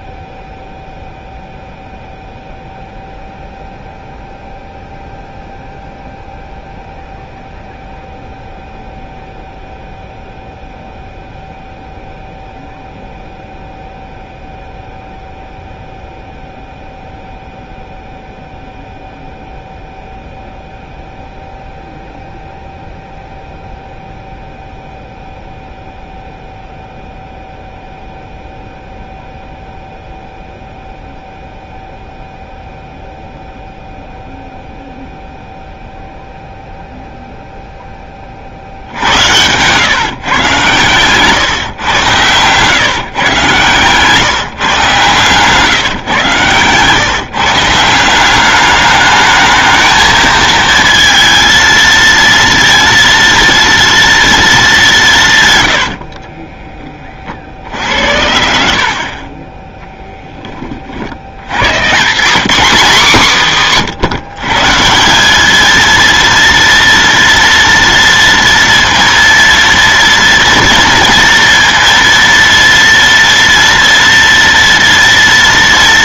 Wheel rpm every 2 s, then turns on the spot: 0, 0, 0, 0, 0, 0, 0, 0, 0, 0, 0, 0, 0, 0, 0, 0, 0, 0, 0, 70, 130, 140, 140, 140, 210, 230, 230, 180, 20, 60, 60, 230, 180, 230, 230, 230, 230, 230.
58-60